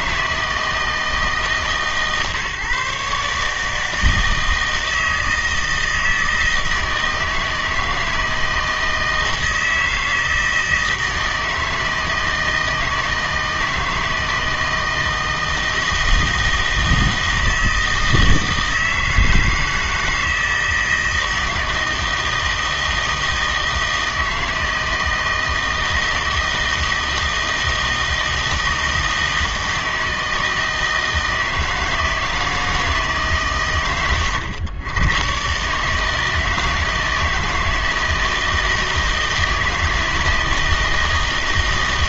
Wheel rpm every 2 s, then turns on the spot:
160, 140, 160, 160, 160, 160, 160, 160, 160, 160, 160, 160, 160, 160, 160, 160, 160, 120, 160, 160, 160.
none